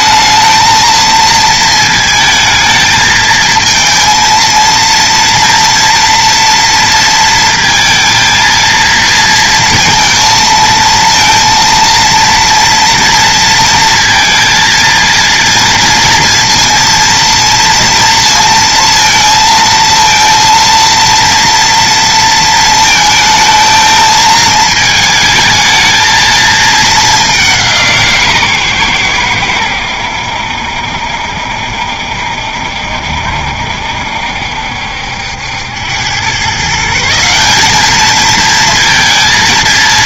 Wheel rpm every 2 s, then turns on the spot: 220, 220, 230, 230, 220, 230, 230, 230, 230, 230, 230, 220, 220, 210, 120, 70, 70, 70, 160, 230.
none